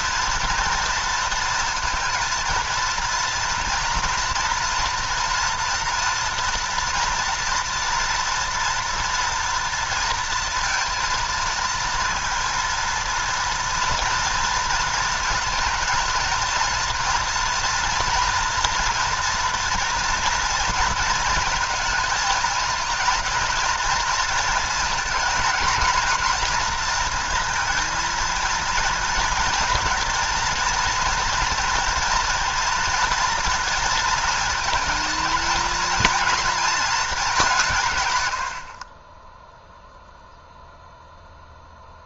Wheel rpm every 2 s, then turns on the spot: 230, 230, 230, 230, 240, 230, 230, 230, 230, 230, 230, 220, 220, 230, 230, 230, 230, 230, 230, 60, 0.
none